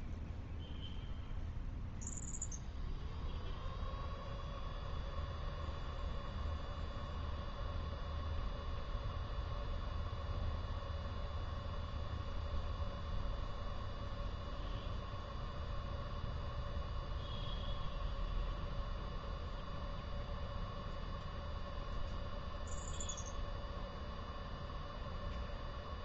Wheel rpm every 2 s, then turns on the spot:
0, 0, 0, 0, 0, 0, 0, 0, 0, 0, 0, 0, 0.
none